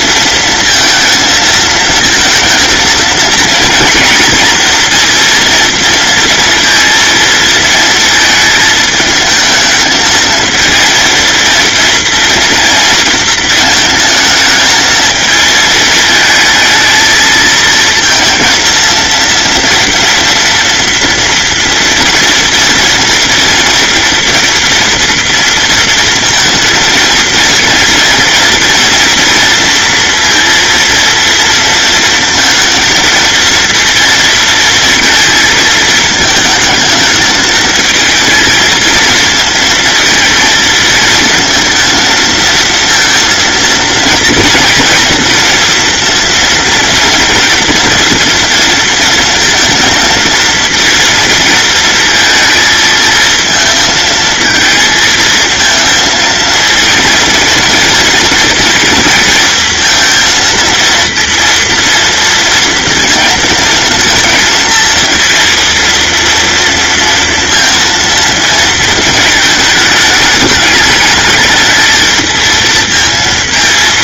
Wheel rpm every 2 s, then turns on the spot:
230, 230, 230, 230, 220, 230, 230, 220, 220, 230, 230, 240, 230, 230, 230, 230, 230, 230, 220, 220, 230, 230, 230, 230, 230, 230, 230, 230, 230, 230, 230, 230, 230, 230, 230, 210, 230.
none